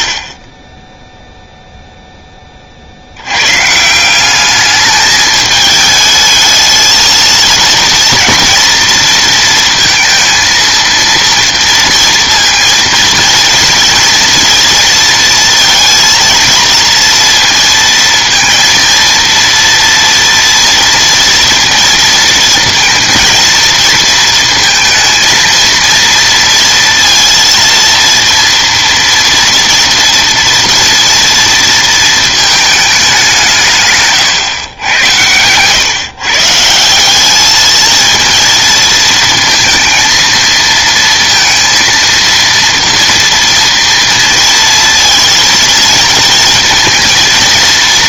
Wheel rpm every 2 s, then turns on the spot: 10, 40, 210, 220, 230, 230, 230, 230, 230, 230, 230, 230, 230, 230, 230, 230, 220, 120, 150, 230, 230, 230, 230, 230.
none